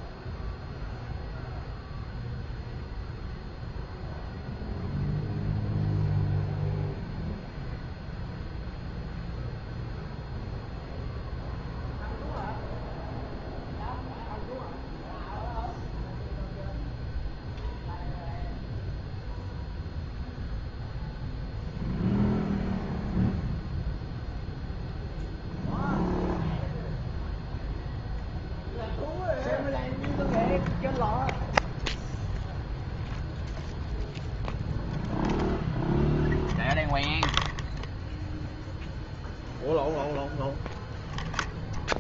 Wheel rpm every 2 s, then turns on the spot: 0, 0, 0, 0, 0, 0, 0, 0, 0, 0, 0, 0, 0, 0, 0, 0, 0, 0, 0, 0, 0.
none